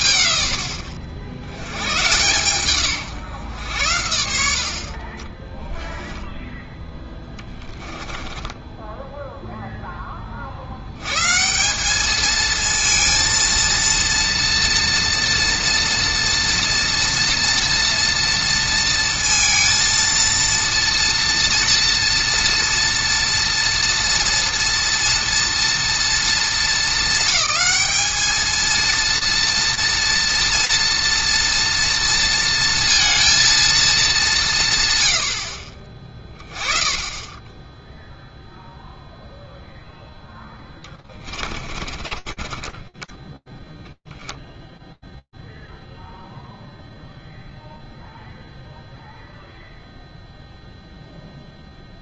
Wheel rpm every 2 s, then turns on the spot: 60, 130, 50, 10, 10, 50, 230, 230, 240, 230, 230, 230, 230, 220, 220, 240, 230, 160, 10, 0, 20, 20, 0, 0, 0, 0.
8-10 40-44